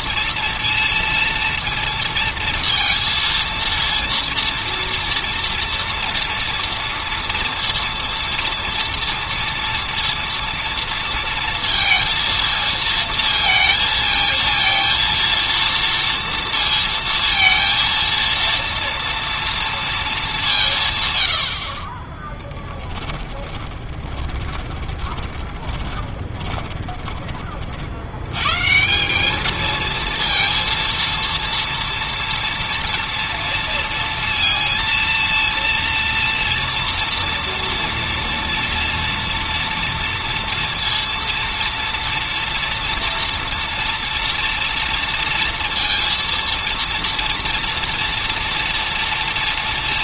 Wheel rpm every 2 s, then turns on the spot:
230, 230, 230, 230, 230, 230, 230, 230, 230, 230, 140, 10, 20, 20, 180, 230, 230, 230, 230, 240, 230, 230, 230, 230, 240.
22-28